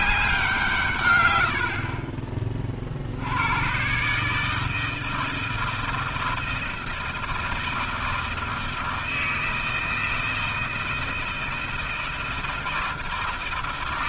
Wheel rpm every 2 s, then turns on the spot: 170, 30, 160, 160, 160, 160, 160.
none